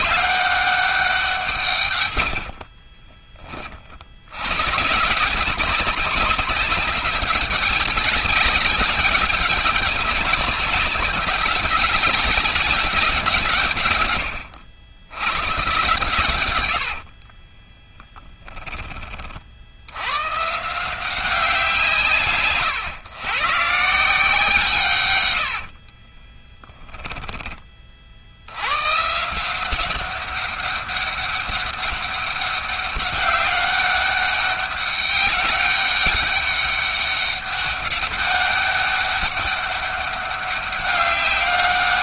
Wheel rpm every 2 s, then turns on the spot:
180, 20, 150, 200, 200, 200, 170, 110, 60, 30, 170, 130, 130, 10, 120, 200, 200, 200, 200, 200, 200.
2-4 16-18